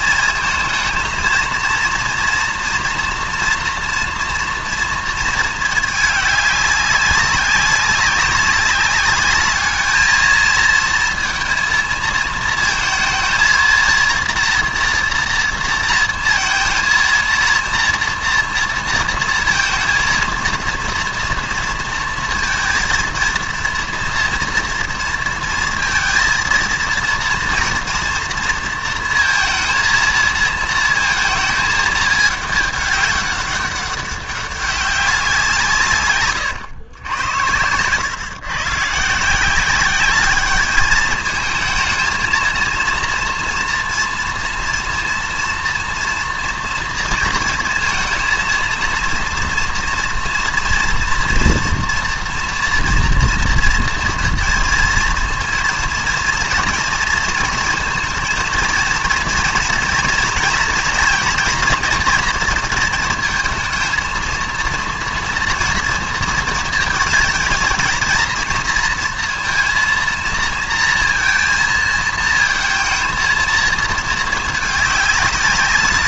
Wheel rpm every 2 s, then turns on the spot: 220, 230, 230, 200, 200, 230, 220, 240, 230, 230, 230, 230, 230, 230, 230, 220, 210, 200, 110, 140, 210, 230, 230, 230, 230, 240, 230, 230, 230, 230, 230, 230, 230, 220, 230, 230, 220, 210.
none